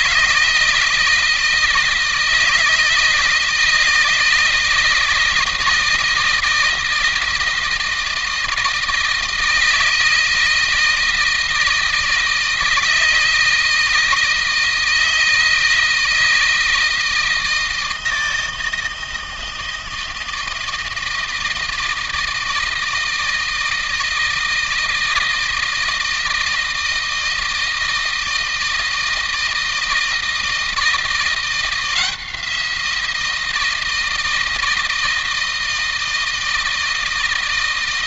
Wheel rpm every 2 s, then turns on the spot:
160, 160, 160, 160, 160, 160, 160, 160, 160, 160, 160, 160, 160, 160, 160, 160, 170, 160, 160.
none